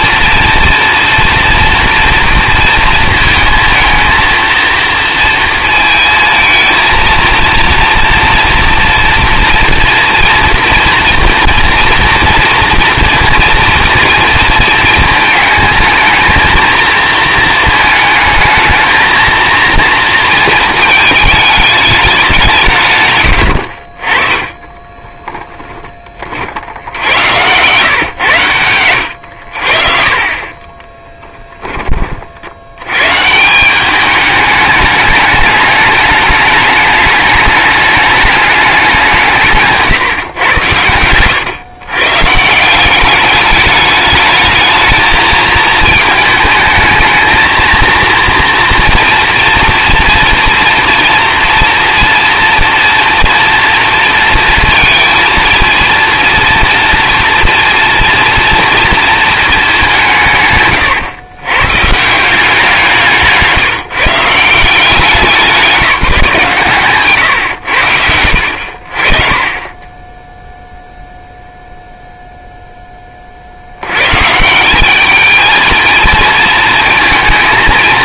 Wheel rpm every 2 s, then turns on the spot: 230, 230, 230, 230, 230, 230, 230, 230, 230, 220, 230, 170, 20, 60, 110, 30, 80, 210, 210, 200, 120, 170, 220, 220, 240, 230, 230, 220, 240, 230, 140, 180, 170, 140, 60, 0, 0, 170, 220.
24-26 28-32